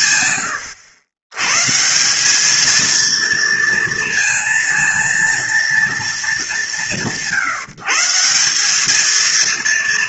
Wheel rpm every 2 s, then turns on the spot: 100, 230, 230, 160, 230.
none